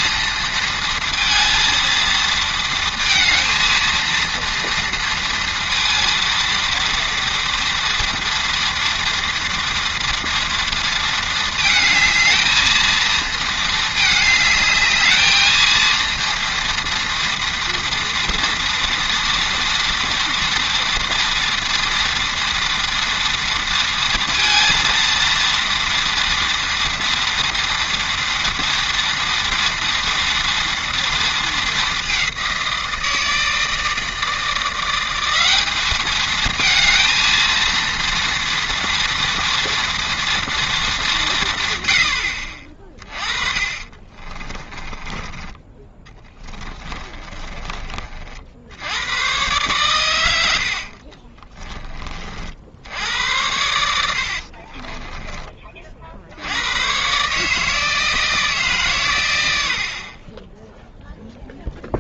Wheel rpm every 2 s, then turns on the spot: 230, 230, 230, 230, 230, 230, 220, 220, 230, 230, 230, 230, 230, 230, 230, 240, 180, 170, 220, 230, 210, 40, 30, 20, 80, 80, 70, 40, 90, 140, 0.
44-48 50-52 54-56